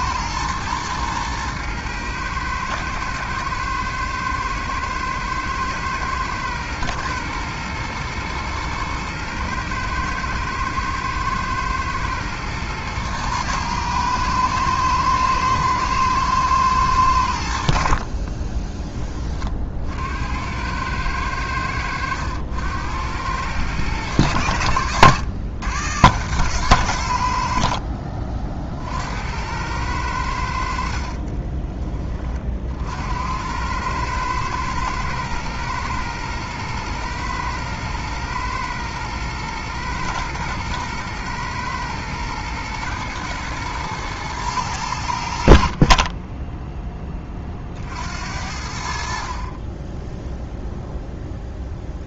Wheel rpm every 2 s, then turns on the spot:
120, 110, 110, 110, 110, 120, 120, 110, 110, 20, 90, 90, 100, 110, 40, 70, 50, 110, 110, 110, 110, 110, 110, 10, 70, 0.
18-20